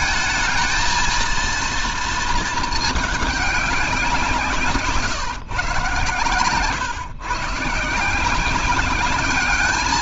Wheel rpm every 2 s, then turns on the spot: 220, 220, 160, 120, 190.
none